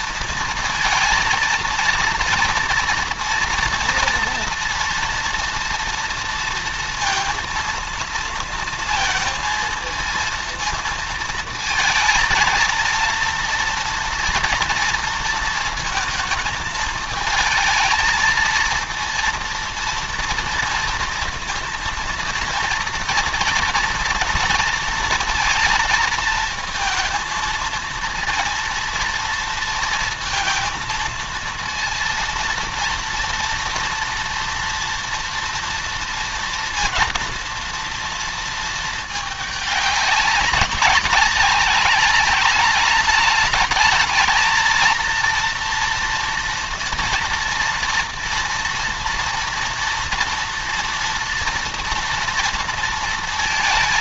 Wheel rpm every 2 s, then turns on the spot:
230, 230, 230, 230, 230, 230, 230, 230, 220, 230, 230, 230, 230, 220, 230, 230, 230, 230, 230, 230, 200, 200, 220, 230, 230, 230, 230.
none